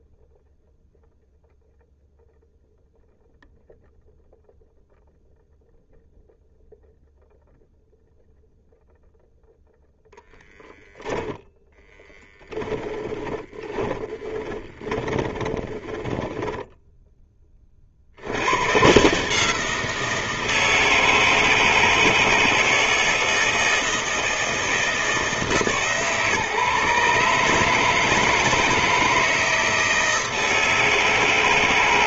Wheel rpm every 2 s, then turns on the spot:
0, 0, 0, 0, 0, 0, 10, 20, 10, 130, 160, 160, 160, 140, 160, 160.
12-16